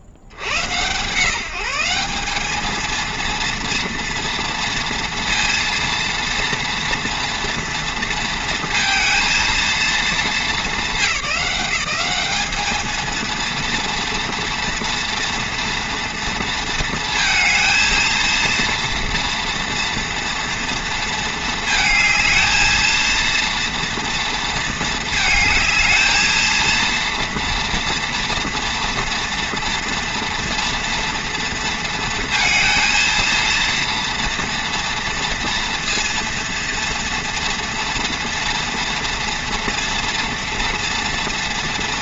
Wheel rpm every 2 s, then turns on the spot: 60, 210, 230, 240, 230, 200, 210, 230, 230, 230, 230, 220, 230, 230, 230, 230, 230, 240, 230, 230, 230.
none